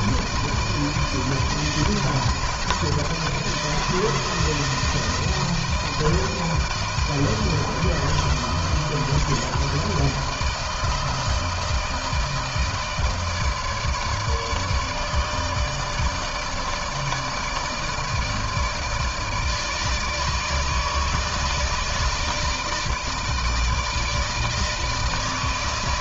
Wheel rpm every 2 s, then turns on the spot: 160, 160, 160, 160, 160, 160, 160, 150, 160, 160, 160, 160, 150.
none